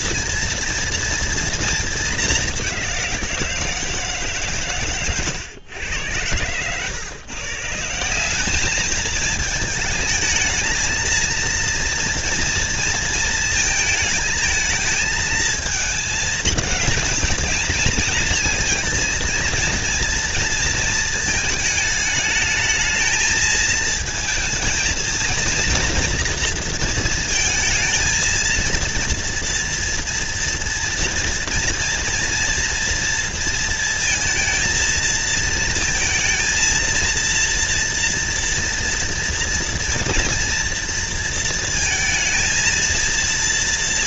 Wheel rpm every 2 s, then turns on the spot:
240, 180, 120, 120, 210, 220, 230, 220, 220, 230, 230, 220, 230, 230, 230, 240, 230, 230, 230, 230, 240, 230.
none